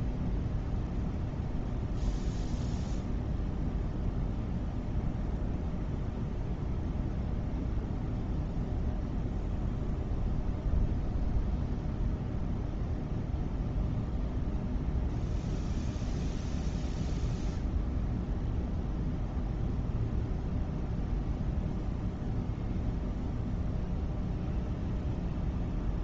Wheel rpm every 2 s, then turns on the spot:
0, 0, 0, 0, 0, 0, 0, 0, 0, 0, 0, 0, 0.
none